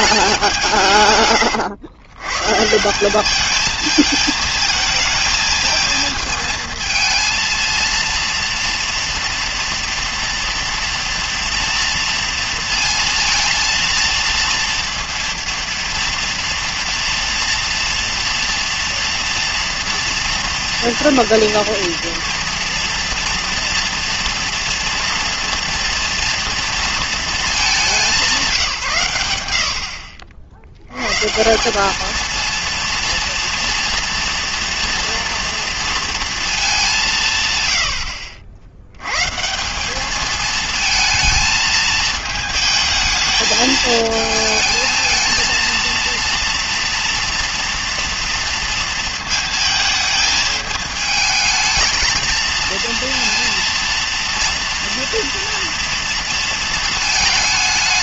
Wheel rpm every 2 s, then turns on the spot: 170, 140, 220, 220, 230, 240, 230, 230, 230, 230, 230, 230, 230, 230, 170, 80, 230, 230, 220, 80, 220, 220, 220, 230, 230, 220, 230, 230, 220.
none